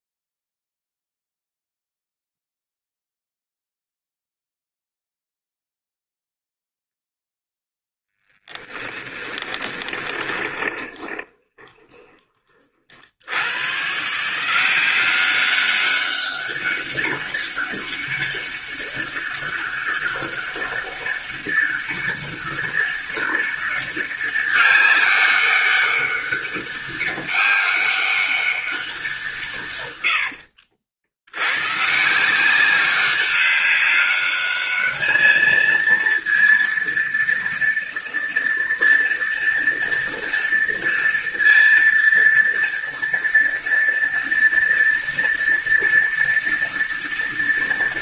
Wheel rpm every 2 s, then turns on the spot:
0, 0, 0, 0, 20, 30, 80, 190, 200, 200, 200, 200, 200, 200, 160, 90, 200, 220, 230, 230, 230, 230, 230, 230.
8-12